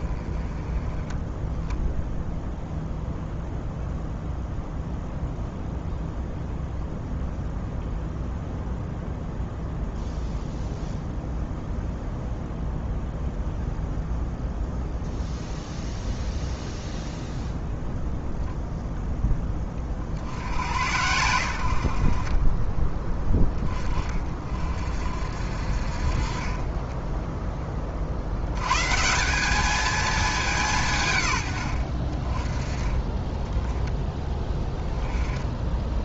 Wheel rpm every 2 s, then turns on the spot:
10, 0, 0, 0, 0, 0, 0, 0, 0, 0, 90, 20, 50, 20, 140, 150, 20, 10.
none